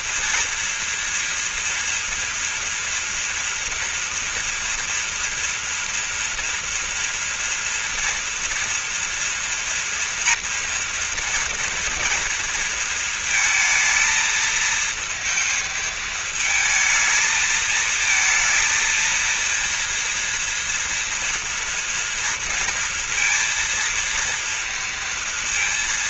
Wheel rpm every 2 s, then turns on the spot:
230, 230, 230, 230, 230, 240, 230, 220, 220, 230, 230, 230, 230.
none